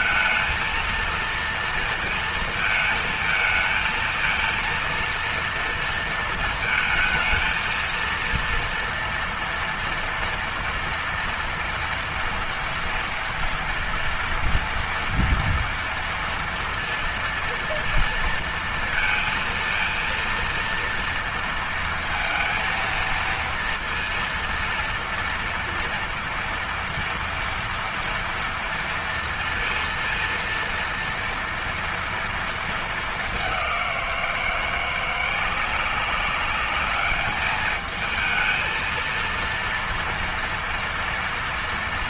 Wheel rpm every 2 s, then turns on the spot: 220, 230, 220, 230, 230, 230, 230, 230, 230, 230, 230, 230, 230, 230, 230, 230, 230, 180, 190, 220, 230.
none